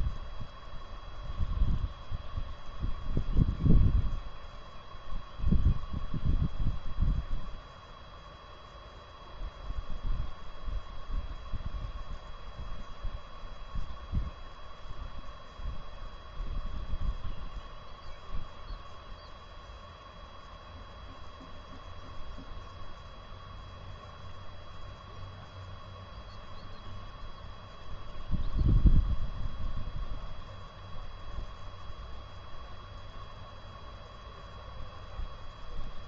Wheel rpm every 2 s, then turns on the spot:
0, 0, 0, 0, 0, 0, 0, 0, 0, 0, 0, 0, 0, 0, 0, 0, 0, 0.
none